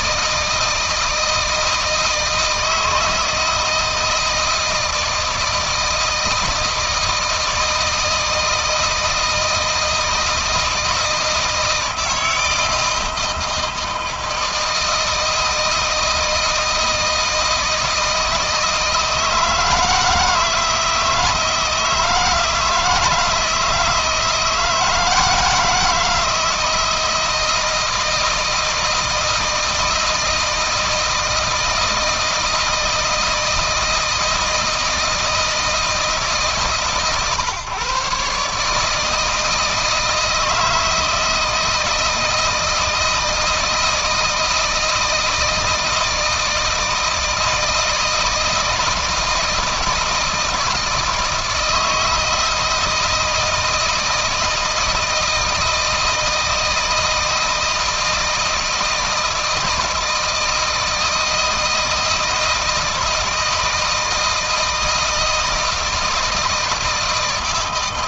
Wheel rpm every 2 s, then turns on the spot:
160, 160, 160, 160, 160, 160, 160, 160, 160, 160, 160, 160, 160, 170, 160, 160, 160, 160, 140, 160, 160, 160, 160, 160, 160, 160, 160, 160, 160, 160, 160, 160, 160, 160.
none